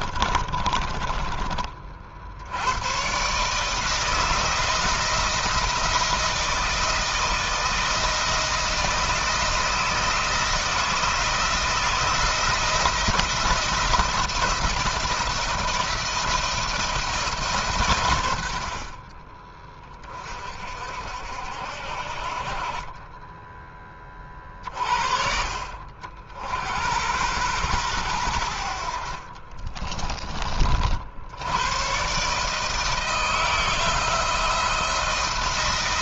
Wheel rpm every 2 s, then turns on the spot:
30, 120, 170, 160, 170, 160, 170, 170, 160, 40, 60, 20, 50, 100, 60, 60, 160, 170.
0-2 28-30